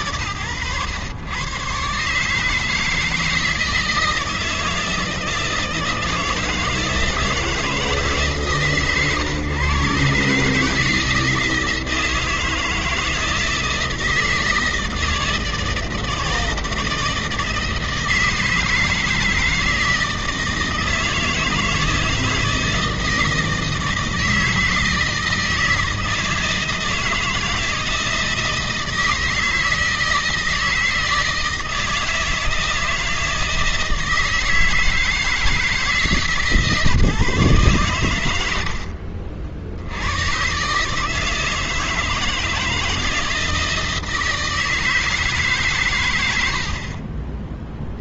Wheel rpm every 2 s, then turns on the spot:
110, 150, 160, 160, 130, 150, 160, 160, 160, 160, 160, 160, 160, 160, 160, 160, 160, 160, 130, 100, 130, 160, 160, 40.
none